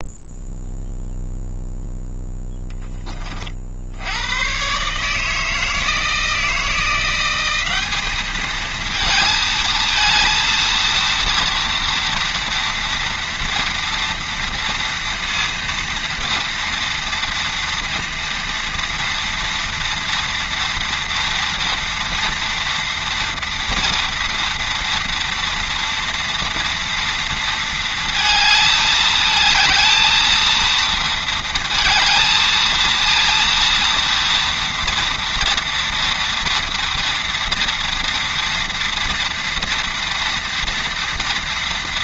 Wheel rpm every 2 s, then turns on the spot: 0, 10, 140, 170, 220, 230, 230, 230, 230, 240, 230, 230, 230, 230, 220, 230, 230, 230, 230, 230, 230.
none